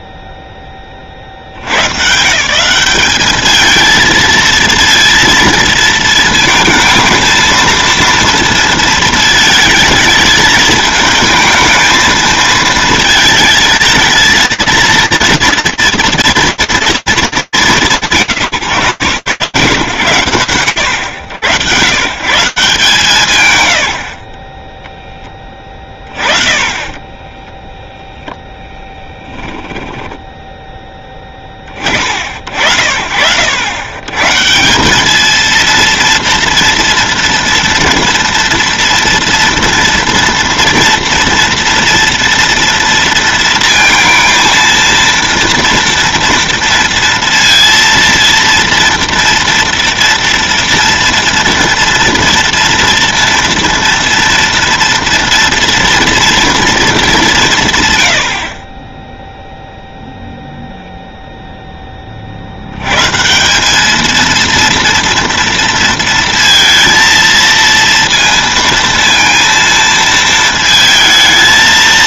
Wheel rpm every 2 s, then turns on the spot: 40, 200, 230, 230, 230, 220, 220, 230, 200, 120, 90, 90, 40, 10, 10, 30, 80, 220, 230, 230, 230, 230, 230, 230, 230, 230, 230, 230, 160, 0, 0, 160, 230, 230, 230, 220.
28-30